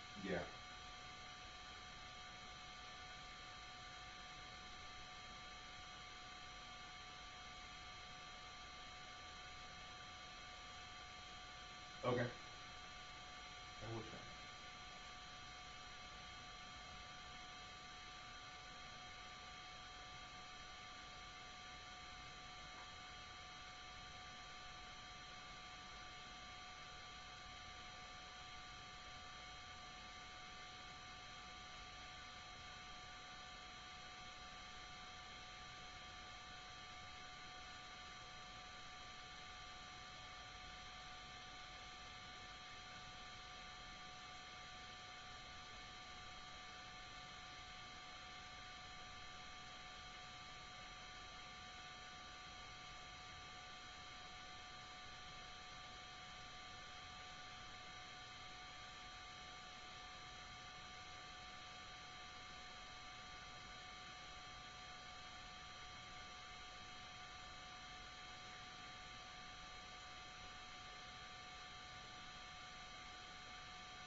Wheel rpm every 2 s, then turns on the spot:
0, 0, 0, 0, 0, 0, 0, 0, 0, 0, 0, 0, 0, 0, 0, 0, 0, 0, 0, 0, 0, 0, 0, 0, 0, 0, 0, 0, 0, 0, 0, 0, 0, 0, 0, 0, 0.
none